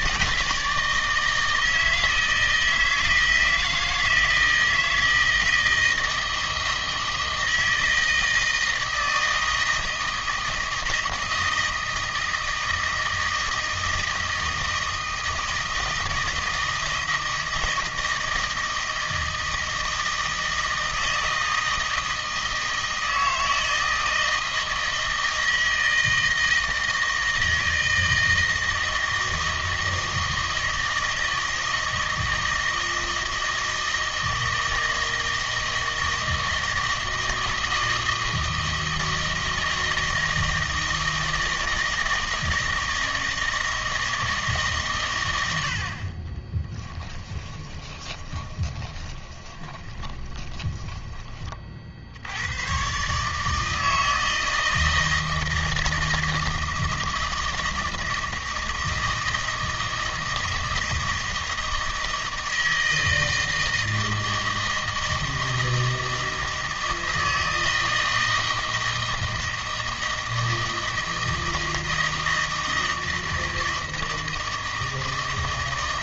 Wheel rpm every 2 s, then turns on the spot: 160, 160, 160, 160, 160, 160, 160, 160, 160, 160, 160, 160, 160, 160, 160, 160, 160, 160, 160, 160, 160, 160, 150, 20, 20, 20, 110, 160, 160, 160, 160, 160, 160, 160, 160, 160, 160, 160.
46-52